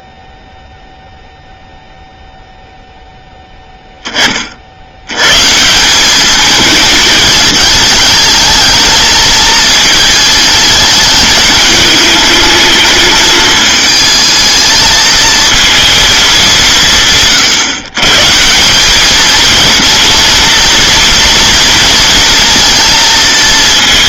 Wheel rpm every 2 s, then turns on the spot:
0, 0, 20, 200, 220, 220, 220, 220, 220, 150, 230, 230.
none